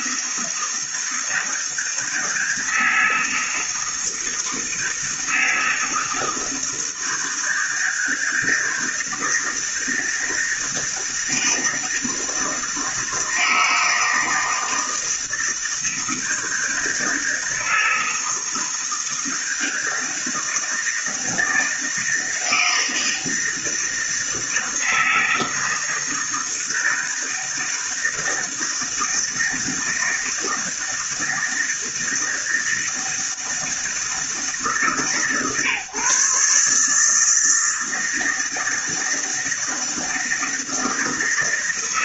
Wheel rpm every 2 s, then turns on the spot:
160, 160, 160, 160, 160, 160, 160, 160, 160, 160, 160, 160, 160, 160, 160, 160, 160, 160, 140, 160, 160.
none